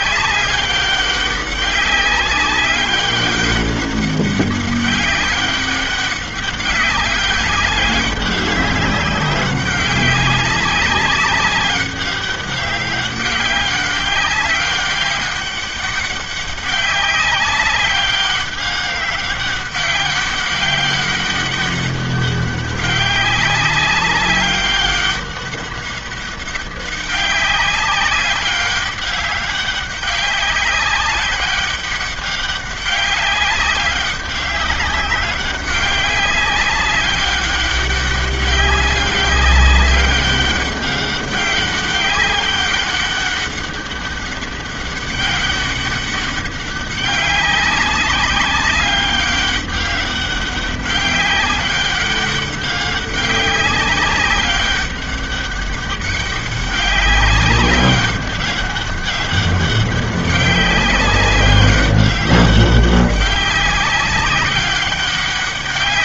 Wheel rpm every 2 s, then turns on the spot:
200, 200, 200, 190, 200, 200, 200, 200, 190, 200, 200, 200, 200, 200, 200, 190, 200, 200, 190, 200, 200, 200, 200, 200, 190, 200, 190, 190, 200, 200, 200, 200, 190.
none